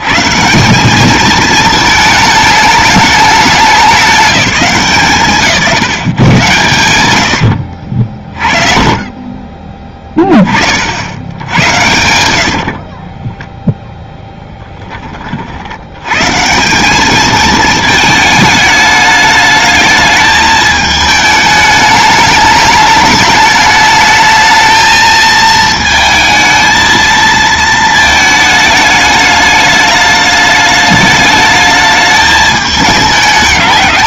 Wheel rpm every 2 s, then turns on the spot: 190, 210, 170, 120, 30, 60, 40, 10, 180, 210, 220, 210, 220, 220, 210, 210, 210.
6-10 12-14